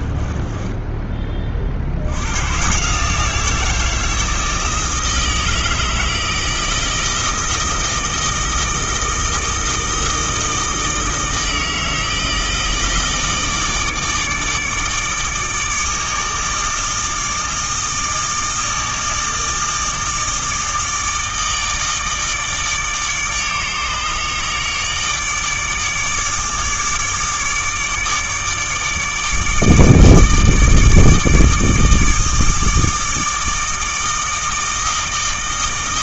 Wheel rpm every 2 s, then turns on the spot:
10, 130, 160, 160, 160, 160, 160, 150, 160, 160, 160, 160, 150, 150, 150, 160, 160, 160.
0-2